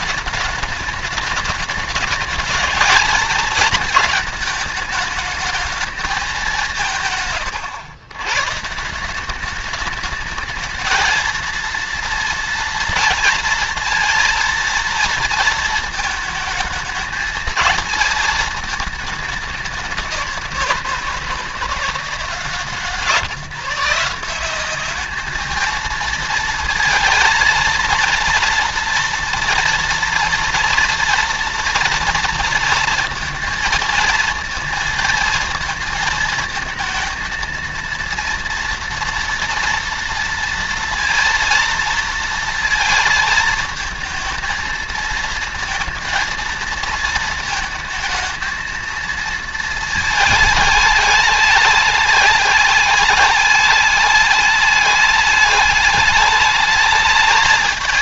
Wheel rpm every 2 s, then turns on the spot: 210, 220, 220, 180, 140, 220, 230, 230, 220, 220, 170, 160, 190, 230, 230, 230, 230, 230, 220, 230, 230, 230, 220, 220, 220, 210, 210, 210, 210.
none